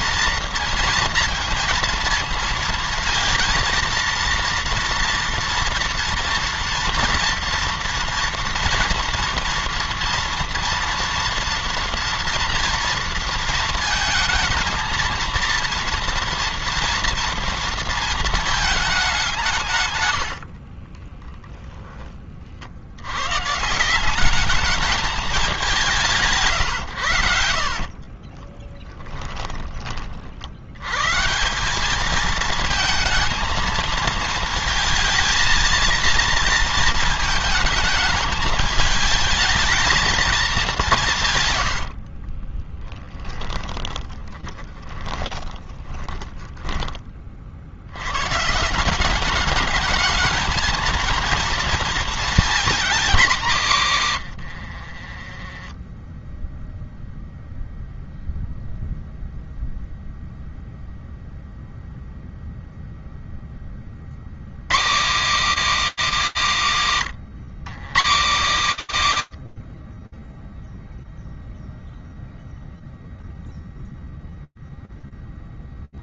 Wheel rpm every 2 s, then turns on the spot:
230, 230, 230, 230, 240, 230, 230, 230, 230, 190, 20, 100, 210, 90, 20, 150, 230, 230, 220, 220, 160, 10, 20, 30, 190, 230, 210, 30, 0, 0, 0, 0, 180, 130, 100, 0, 0, 0.
20-22 40-46 54-56